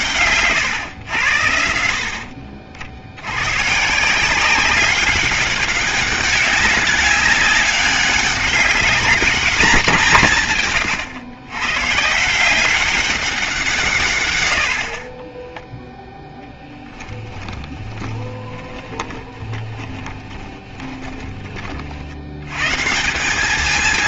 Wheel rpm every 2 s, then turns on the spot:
140, 50, 180, 200, 200, 140, 170, 90, 0, 20, 20, 120.
18-22